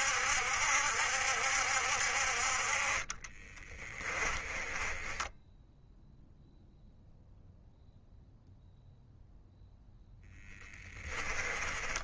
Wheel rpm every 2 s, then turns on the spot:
70, 40, 20, 0, 0, 20.
2-6 10-12